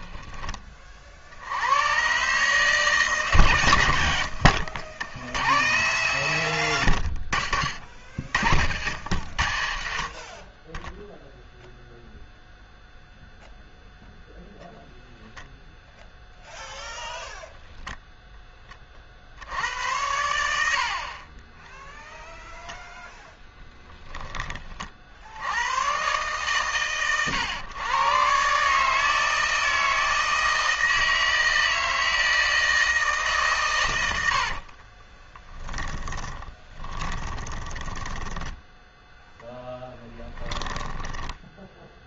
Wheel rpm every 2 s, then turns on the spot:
40, 160, 80, 110, 80, 20, 0, 0, 0, 10, 70, 0, 30, 130, 140, 160, 160, 50, 30, 10, 20.
4-6 34-38 40-42